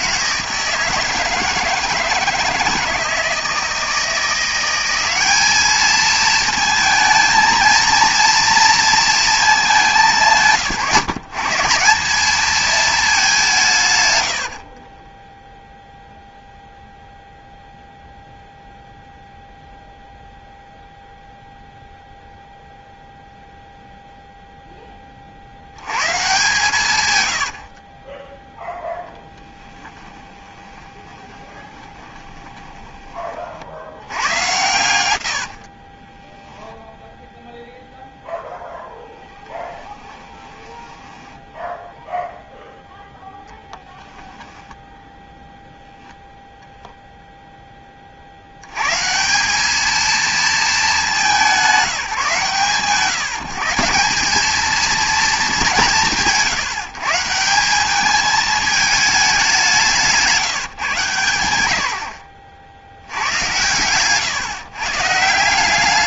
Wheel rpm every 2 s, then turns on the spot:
160, 160, 180, 220, 230, 140, 220, 50, 0, 0, 0, 0, 10, 130, 0, 20, 20, 120, 0, 0, 10, 0, 0, 0, 140, 200, 150, 230, 150, 210, 130, 80, 130.
14-16 30-34 40-42